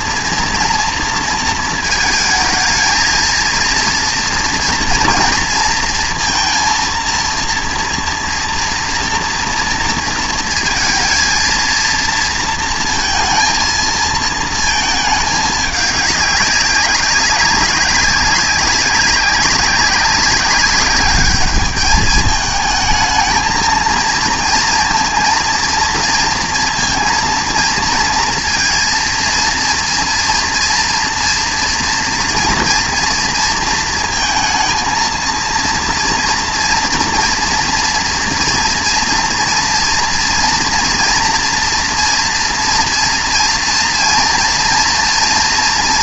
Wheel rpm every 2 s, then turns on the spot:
230, 220, 230, 230, 230, 230, 230, 230, 200, 200, 200, 220, 230, 230, 230, 230, 230, 230, 240, 230, 230, 230, 230.
none